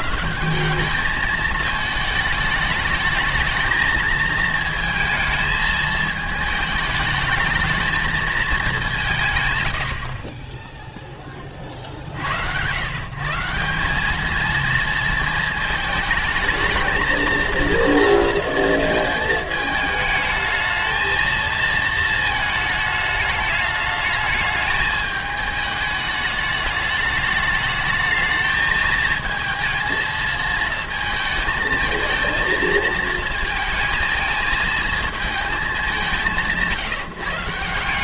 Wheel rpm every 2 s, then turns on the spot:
190, 210, 220, 210, 200, 10, 110, 230, 220, 230, 220, 220, 210, 210, 220, 220, 220, 220, 160.
none